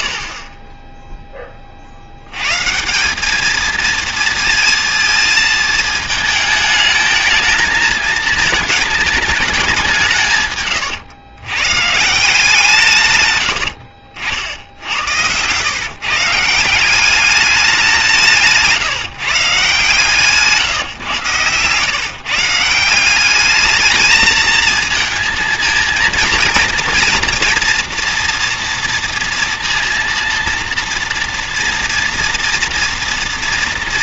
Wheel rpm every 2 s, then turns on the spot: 20, 140, 230, 220, 220, 130, 160, 80, 170, 160, 150, 170, 220, 230, 230, 230, 230.
none